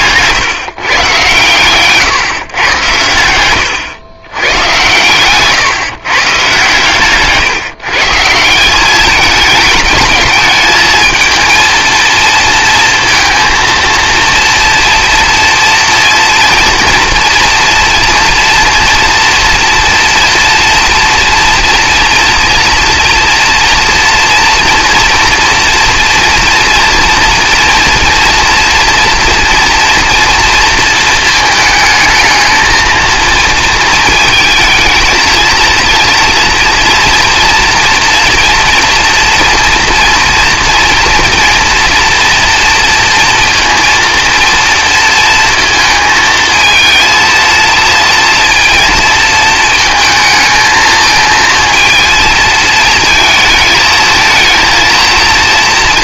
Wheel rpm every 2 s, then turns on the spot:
140, 140, 120, 130, 170, 210, 230, 230, 230, 230, 230, 230, 230, 230, 230, 230, 220, 230, 230, 230, 230, 230, 230, 220, 230, 220, 230, 220.
0-2